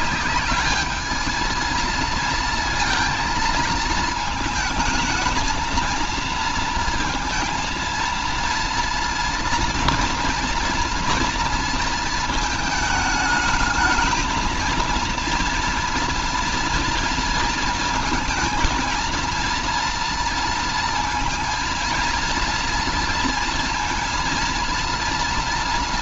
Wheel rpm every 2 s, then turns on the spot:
210, 230, 220, 230, 230, 240, 220, 230, 230, 230, 230, 230, 230.
none